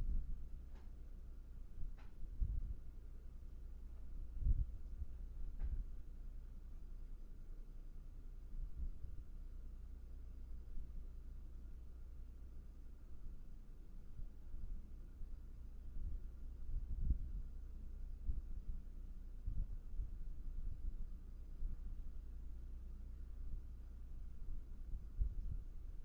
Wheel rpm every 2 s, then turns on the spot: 0, 0, 0, 0, 0, 0, 0, 0, 0, 0, 0, 0, 0.
none